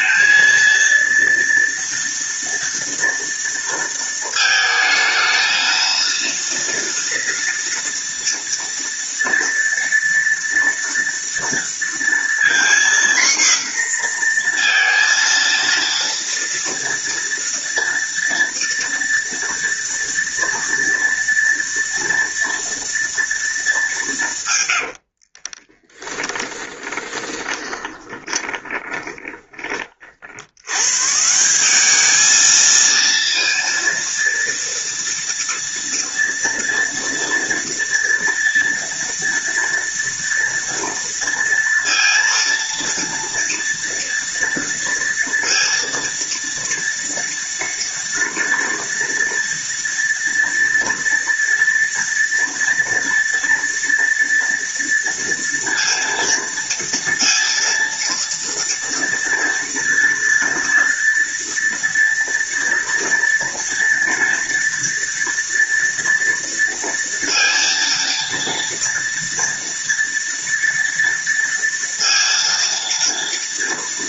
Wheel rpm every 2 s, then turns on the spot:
230, 240, 220, 230, 230, 230, 240, 230, 230, 230, 230, 230, 130, 30, 20, 100, 220, 230, 230, 230, 230, 230, 230, 230, 230, 230, 230, 230, 230, 230, 230, 230, 230, 230, 230, 230, 230.
24-30